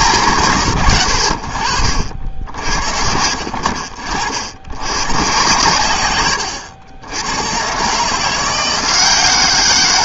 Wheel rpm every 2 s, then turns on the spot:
120, 70, 90, 90, 170.
2-4